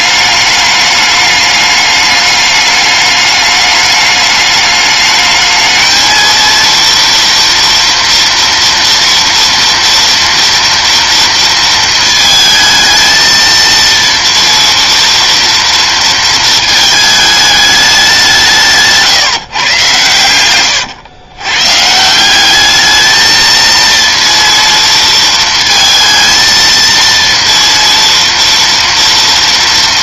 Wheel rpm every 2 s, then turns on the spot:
210, 210, 210, 230, 230, 230, 220, 230, 220, 160, 120, 210, 230, 230, 230.
20-22